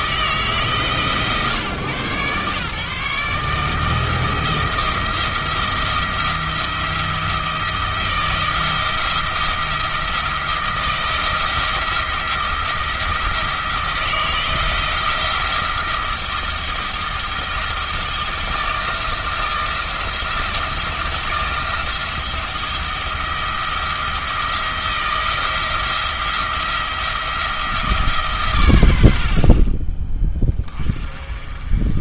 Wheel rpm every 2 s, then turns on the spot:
150, 140, 160, 170, 170, 170, 170, 170, 160, 170, 170, 170, 170, 170, 100, 30.
none